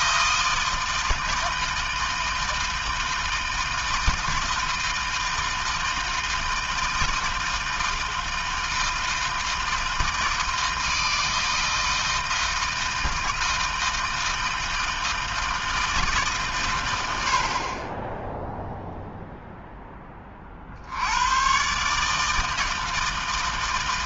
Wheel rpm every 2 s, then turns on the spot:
160, 160, 160, 160, 160, 160, 160, 160, 80, 0, 90, 160.
none